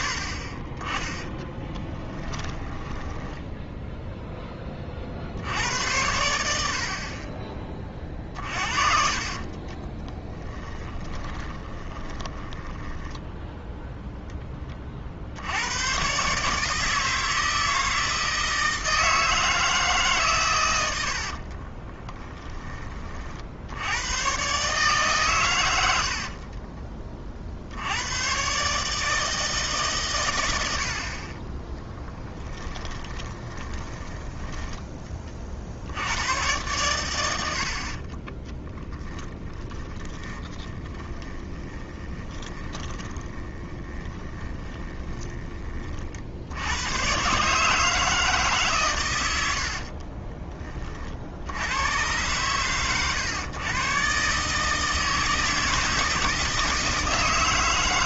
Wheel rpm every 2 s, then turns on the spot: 50, 10, 30, 60, 40, 10, 10, 40, 160, 160, 90, 20, 140, 30, 140, 70, 30, 20, 110, 10, 20, 20, 20, 100, 130, 40, 120, 150, 150.
2-4 8-14 32-34 38-46